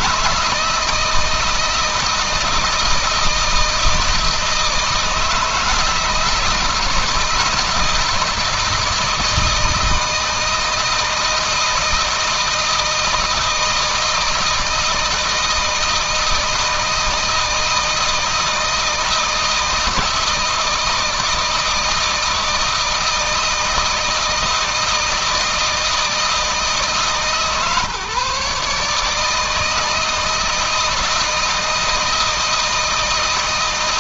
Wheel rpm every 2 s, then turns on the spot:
160, 160, 160, 160, 170, 160, 160, 160, 160, 160, 160, 160, 160, 160, 150, 160, 160.
none